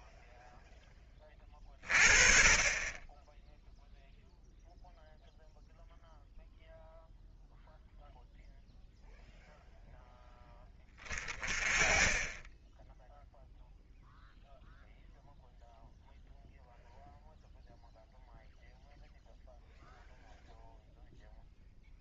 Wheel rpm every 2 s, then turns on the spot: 20, 10, 0, 0, 0, 20, 0, 0, 0, 0, 0.
none